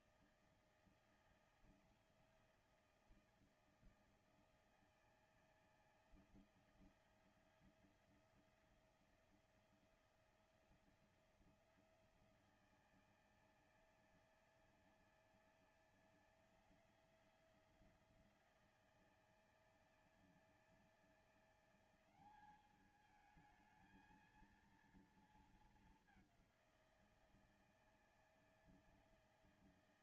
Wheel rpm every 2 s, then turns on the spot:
160, 160, 160, 160, 170, 170, 160, 160, 170, 160, 170, 210, 230, 180, 160.
none